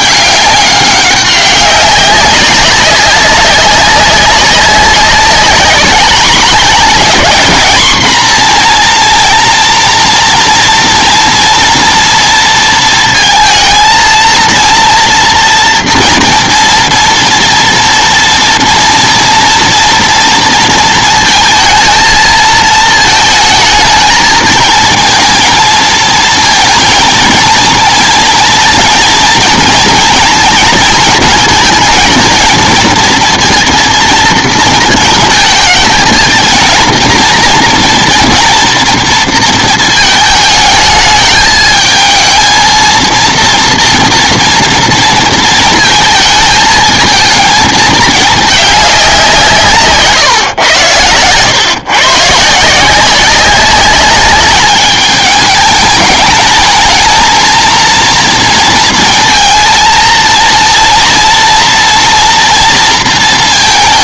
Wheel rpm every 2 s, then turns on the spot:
200, 200, 200, 210, 230, 230, 220, 230, 230, 230, 230, 230, 220, 230, 230, 230, 230, 220, 230, 240, 220, 230, 230, 220, 200, 110, 170, 210, 220, 230, 230, 230.
none